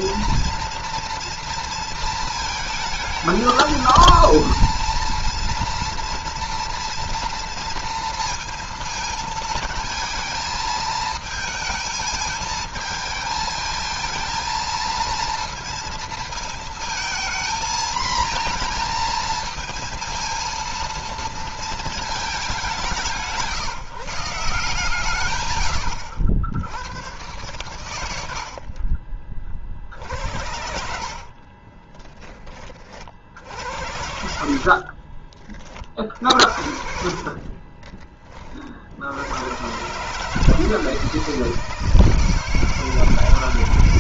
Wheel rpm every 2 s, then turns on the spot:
230, 220, 230, 230, 220, 220, 220, 230, 230, 230, 230, 190, 150, 90, 50, 60, 40, 50, 50, 60, 160, 160.
30-32 34-38